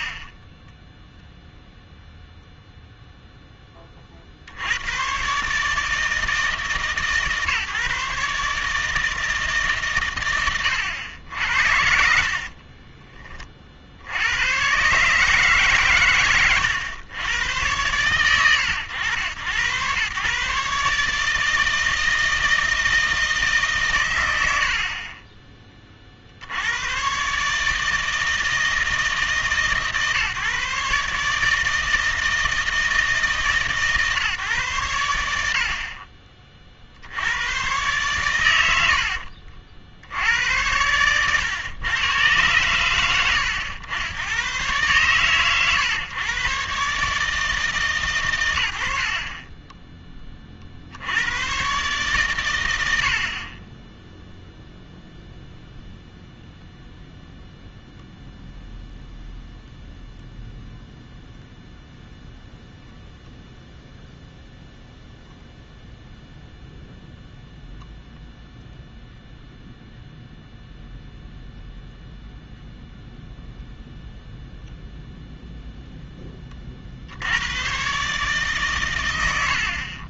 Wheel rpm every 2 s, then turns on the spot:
30, 0, 90, 160, 150, 120, 30, 120, 110, 100, 140, 160, 70, 100, 160, 140, 160, 120, 50, 80, 90, 110, 110, 130, 100, 40, 100, 0, 0, 0, 0, 0, 0, 0, 0, 0, 0, 0, 50, 130.
0-2 12-14 16-18